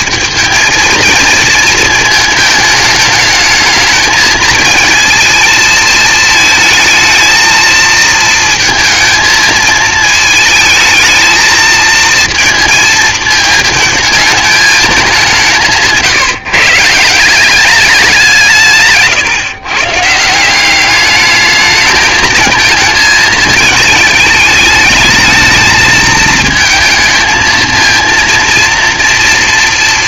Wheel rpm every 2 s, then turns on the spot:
230, 220, 220, 220, 230, 220, 230, 220, 150, 170, 190, 220, 210, 220, 230.
none